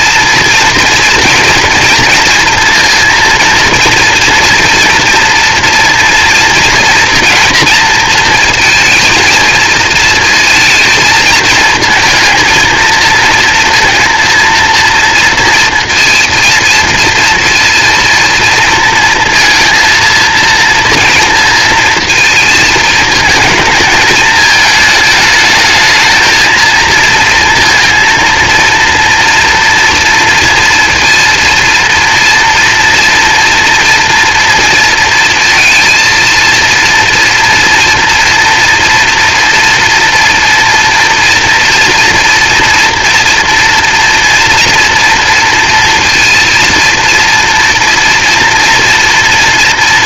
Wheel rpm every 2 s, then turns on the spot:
230, 230, 230, 230, 230, 230, 230, 230, 230, 230, 230, 220, 210, 230, 230, 230, 240, 230, 230, 230, 230, 230, 230, 230, 230.
none